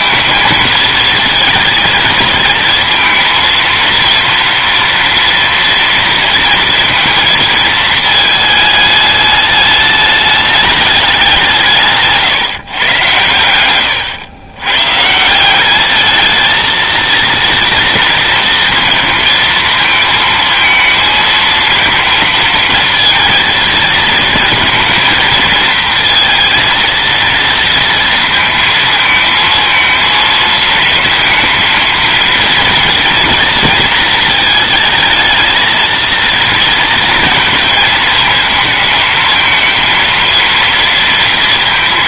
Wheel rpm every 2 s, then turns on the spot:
220, 230, 230, 230, 210, 200, 120, 140, 220, 230, 220, 230, 230, 230, 220, 230, 230, 220, 230, 220, 230.
none